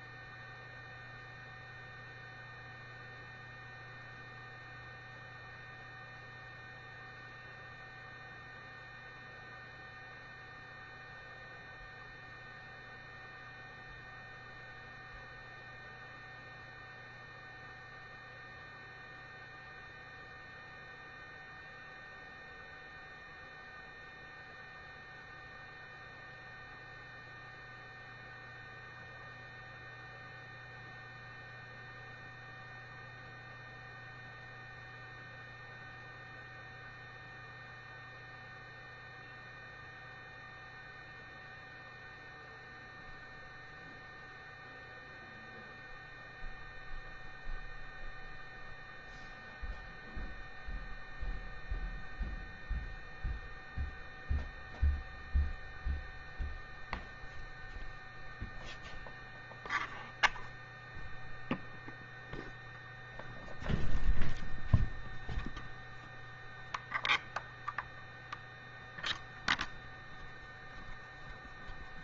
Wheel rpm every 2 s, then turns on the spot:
0, 0, 0, 0, 0, 0, 0, 0, 0, 0, 0, 0, 0, 0, 0, 0, 0, 0, 0, 0, 0, 0, 0, 0, 0, 0, 0, 0, 0, 0, 0, 0, 0, 0, 0, 0.
none